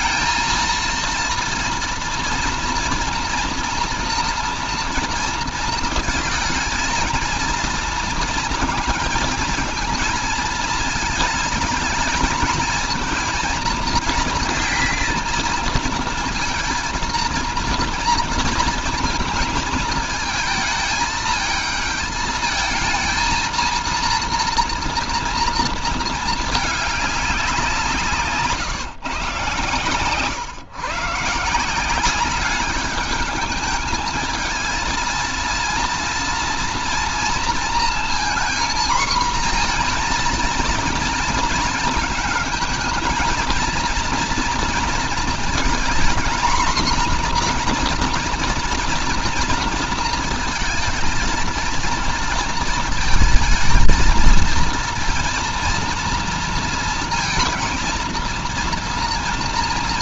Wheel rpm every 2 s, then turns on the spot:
230, 240, 230, 230, 230, 230, 220, 220, 230, 230, 220, 220, 230, 210, 140, 150, 200, 220, 230, 240, 240, 220, 230, 240, 230, 230, 230, 230, 230, 230.
none